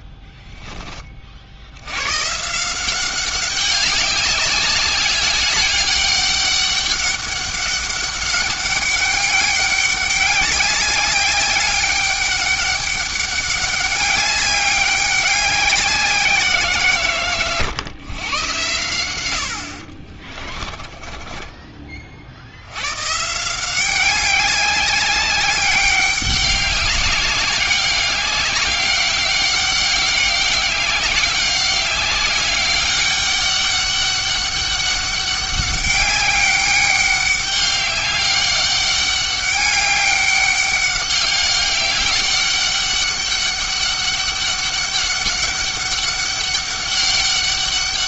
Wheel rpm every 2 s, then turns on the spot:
10, 160, 200, 200, 200, 200, 200, 200, 160, 100, 20, 100, 200, 200, 200, 190, 200, 200, 200, 200, 200, 200, 200, 200.
20-22